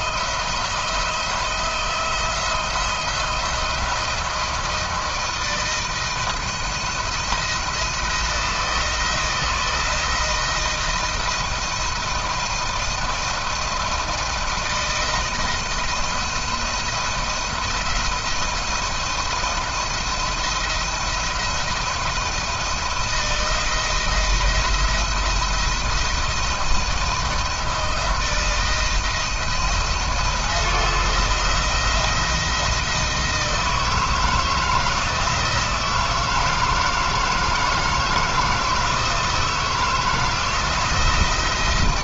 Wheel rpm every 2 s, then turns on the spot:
160, 170, 160, 160, 160, 170, 170, 160, 170, 170, 160, 160, 170, 160, 170, 170, 160, 160, 160, 160, 160.
none